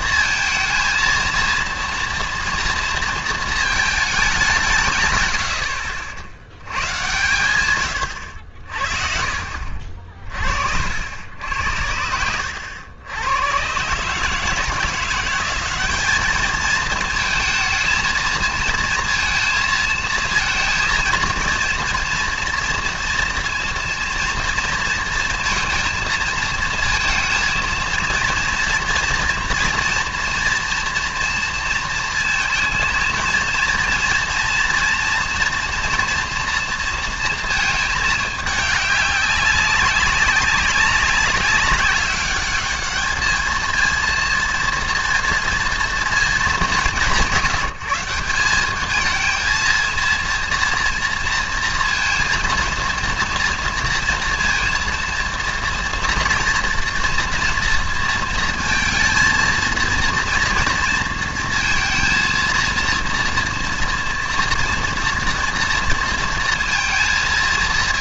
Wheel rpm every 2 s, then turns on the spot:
230, 230, 150, 100, 60, 60, 90, 160, 220, 230, 220, 230, 230, 220, 230, 240, 230, 230, 230, 210, 190, 210, 230, 210, 210, 230, 230, 230, 230, 230, 230, 230, 230, 230.
none